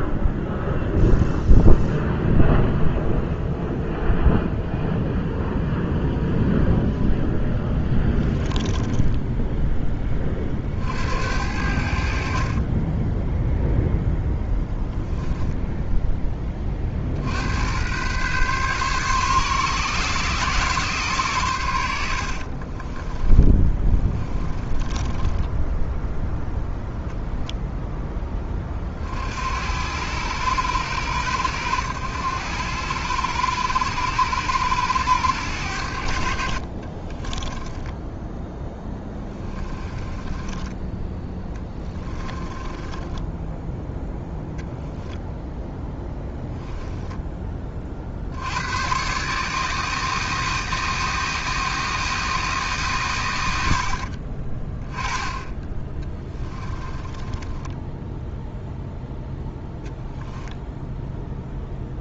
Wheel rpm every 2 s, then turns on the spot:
0, 0, 0, 0, 10, 60, 20, 0, 40, 130, 130, 30, 20, 0, 30, 100, 100, 100, 40, 10, 10, 20, 0, 10, 110, 160, 150, 20, 30, 0, 0.
8-10 12-14 22-26 36-44 56-58